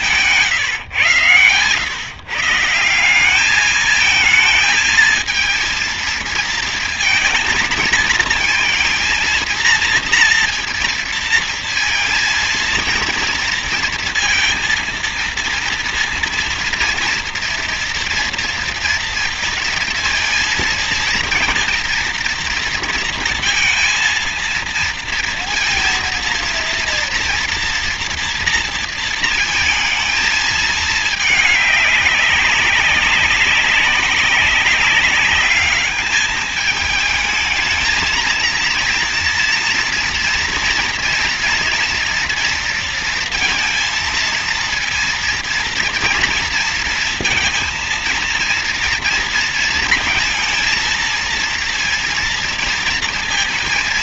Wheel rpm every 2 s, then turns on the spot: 130, 160, 220, 230, 230, 230, 230, 230, 230, 230, 230, 230, 230, 230, 230, 220, 200, 210, 210, 230, 240, 230, 230, 230, 230, 230, 230.
none